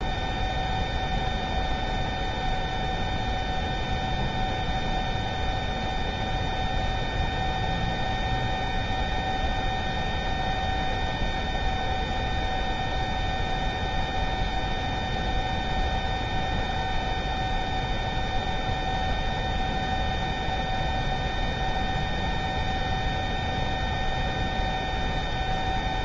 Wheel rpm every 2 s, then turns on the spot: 0, 0, 0, 0, 0, 0, 0, 0, 0, 0, 0, 0, 0.
none